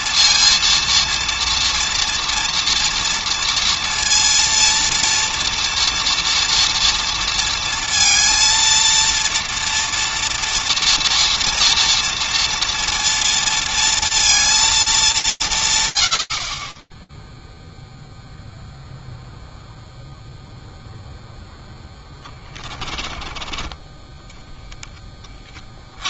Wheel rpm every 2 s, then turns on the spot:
230, 230, 230, 230, 230, 230, 230, 220, 30, 0, 0, 20, 20.
none